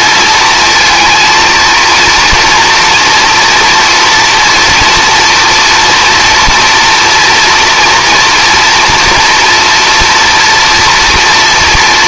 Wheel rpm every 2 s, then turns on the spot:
230, 240, 240, 230, 230, 230.
none